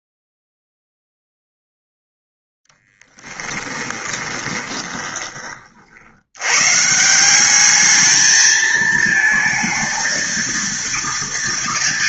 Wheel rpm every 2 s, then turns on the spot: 0, 0, 20, 150, 220, 230.
none